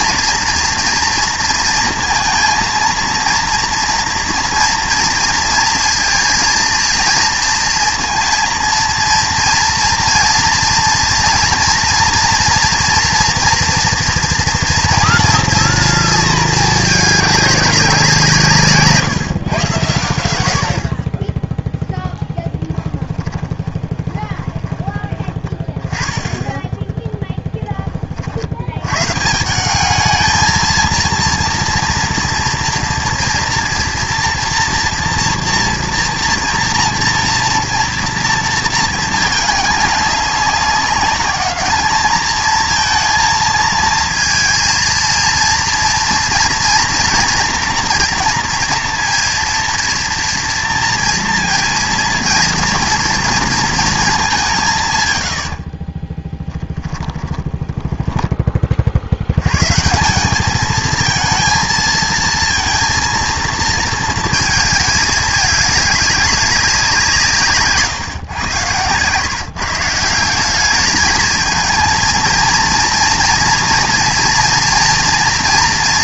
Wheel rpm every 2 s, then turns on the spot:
230, 230, 240, 230, 230, 230, 230, 240, 220, 170, 70, 20, 20, 10, 80, 220, 230, 230, 230, 230, 200, 220, 230, 230, 230, 230, 230, 180, 10, 30, 210, 230, 220, 190, 110, 190, 230, 230.
22-26 56-58